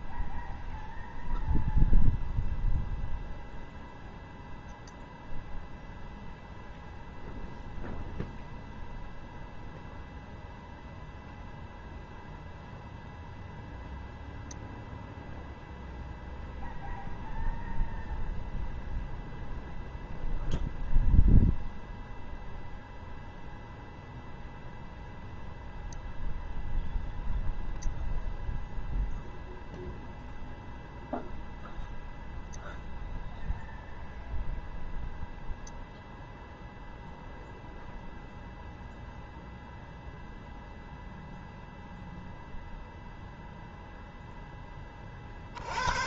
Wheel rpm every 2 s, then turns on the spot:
0, 0, 0, 0, 0, 0, 0, 0, 0, 0, 0, 0, 0, 0, 0, 0, 0, 0, 0, 0, 0, 0, 20.
none